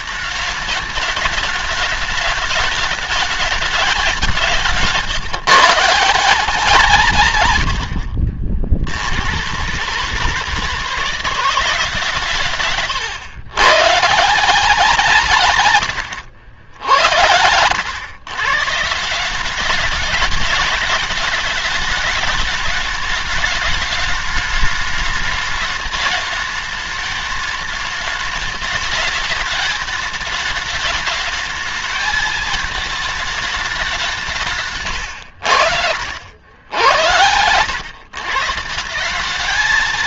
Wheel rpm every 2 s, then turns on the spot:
220, 210, 170, 160, 70, 170, 130, 170, 80, 140, 210, 210, 210, 210, 210, 210, 220, 140, 80, 160.
none